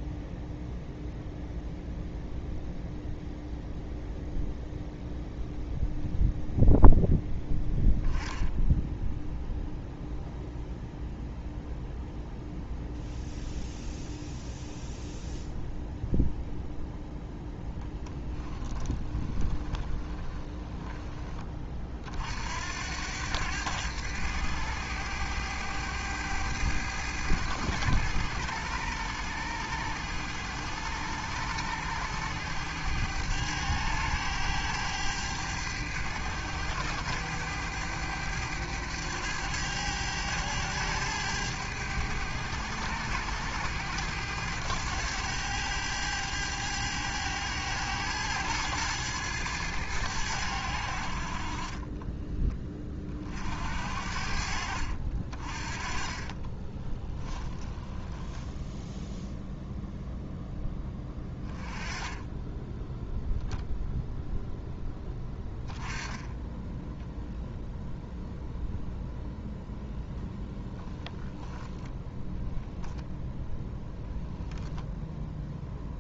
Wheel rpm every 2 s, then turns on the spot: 0, 0, 0, 0, 0, 0, 0, 0, 0, 20, 20, 90, 100, 100, 100, 100, 100, 100, 100, 100, 100, 100, 100, 100, 110, 60, 30, 60, 20, 0, 10, 0, 10, 0, 0, 0, 0, 0.
18-20 56-58